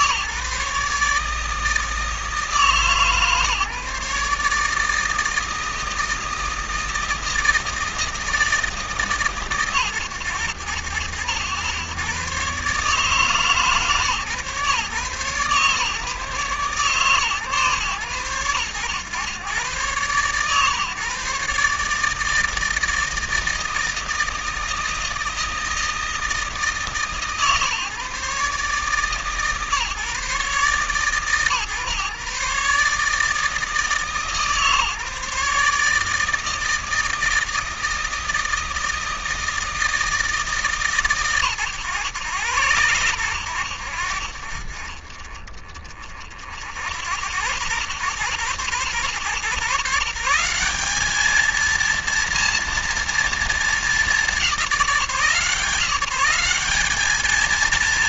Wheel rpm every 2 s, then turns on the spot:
150, 150, 160, 160, 150, 100, 140, 140, 140, 120, 130, 160, 160, 150, 150, 140, 150, 150, 160, 160, 140, 100, 30, 60, 110, 200, 230, 170, 210.
none